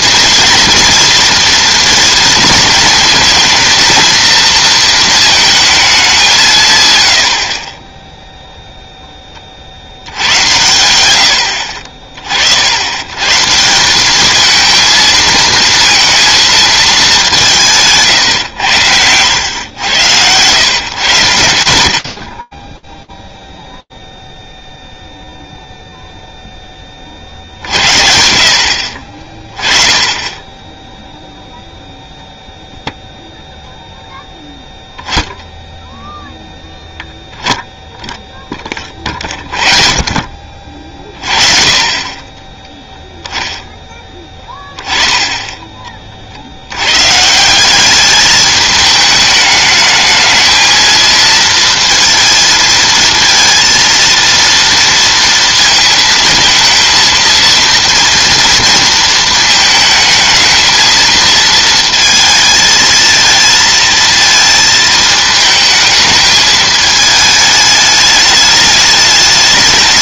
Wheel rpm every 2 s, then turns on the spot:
240, 230, 220, 110, 0, 100, 70, 220, 220, 90, 120, 20, 0, 30, 60, 0, 0, 10, 0, 30, 50, 10, 10, 110, 210, 230, 230, 230, 230, 230, 220, 220, 220, 210, 210.
44-46